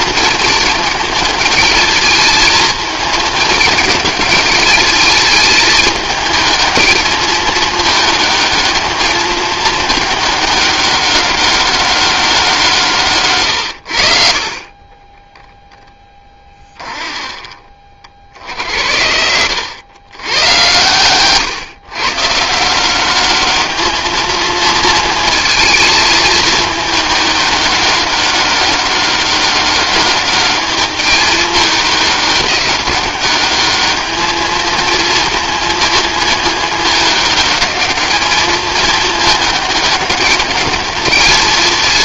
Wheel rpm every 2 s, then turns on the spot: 220, 220, 210, 220, 220, 200, 170, 30, 20, 70, 120, 160, 220, 220, 200, 210, 200, 220, 210, 210, 210.
16-18